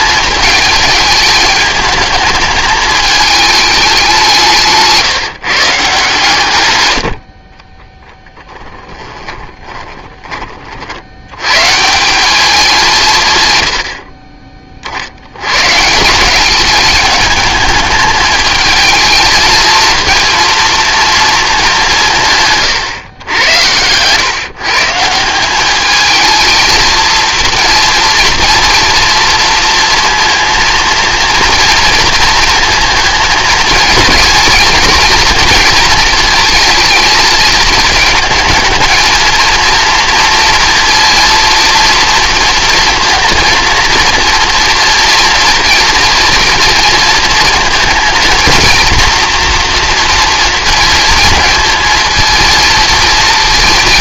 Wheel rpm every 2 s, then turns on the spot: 210, 210, 150, 110, 20, 60, 180, 40, 200, 220, 230, 130, 160, 230, 240, 230, 230, 220, 220, 220, 230, 230, 230, 230, 230, 230, 230.
8-10